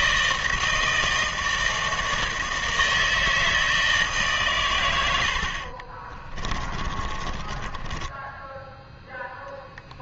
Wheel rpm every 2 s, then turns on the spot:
160, 160, 130, 30, 10.
6-8